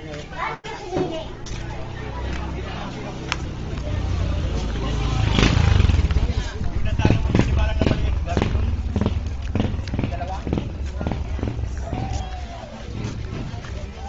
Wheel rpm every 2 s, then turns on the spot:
0, 0, 0, 0, 0, 0, 0.
none